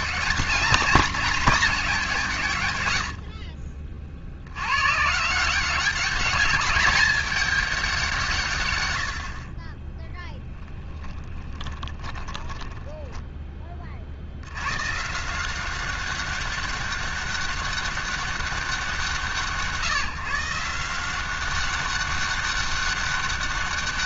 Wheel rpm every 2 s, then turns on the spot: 210, 80, 80, 210, 150, 10, 20, 90, 190, 190, 160, 200.
10-14